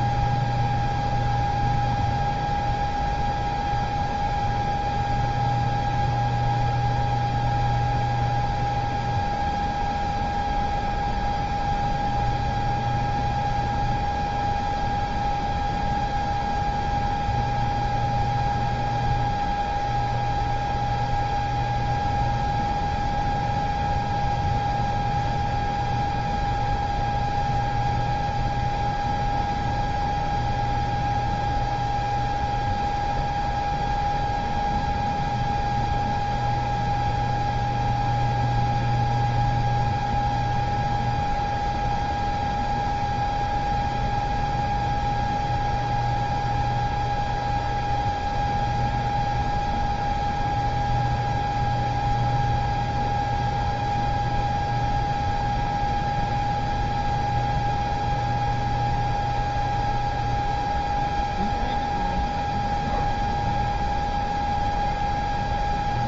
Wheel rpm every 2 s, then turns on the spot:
0, 0, 0, 0, 0, 0, 0, 0, 0, 0, 0, 0, 0, 0, 0, 0, 0, 0, 0, 0, 0, 0, 0, 0, 0, 0, 0, 0, 0, 0, 0, 0, 0.
none